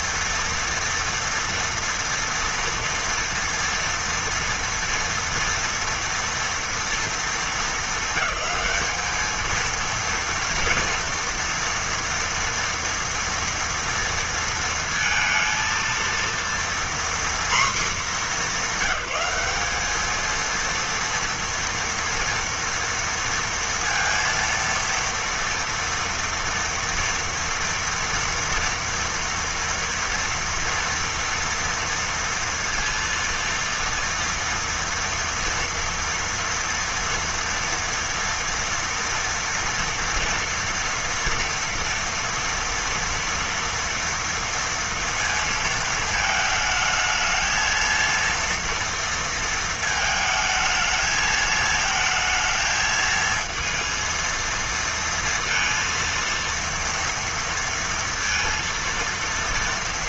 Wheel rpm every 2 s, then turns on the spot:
230, 230, 230, 230, 200, 240, 230, 230, 240, 210, 230, 230, 230, 230, 230, 230, 230, 230, 230, 230, 230, 230, 230, 220, 230, 220, 220, 230, 230, 230.
none